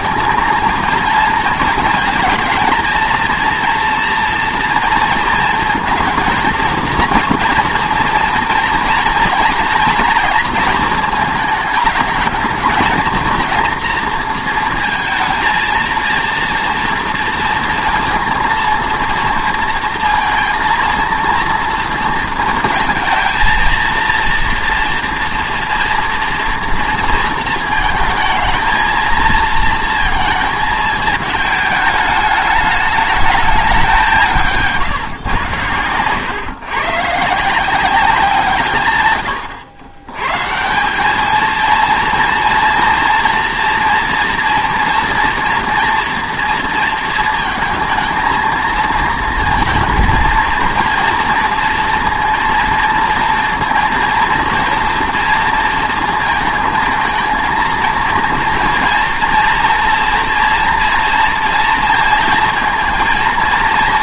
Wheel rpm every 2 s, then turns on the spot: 220, 230, 230, 230, 230, 230, 210, 230, 230, 230, 230, 230, 230, 230, 220, 220, 210, 150, 130, 140, 170, 230, 230, 230, 230, 230, 230, 230, 220, 230, 230, 230.
none